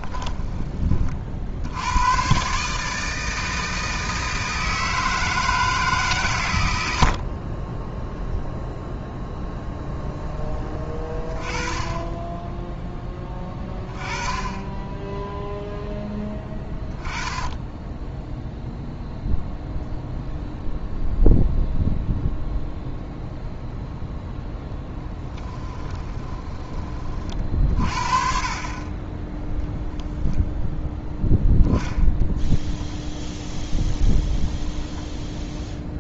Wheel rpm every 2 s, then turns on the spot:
30, 140, 160, 50, 0, 10, 10, 10, 10, 0, 0, 0, 0, 30, 30, 0, 0, 0.
none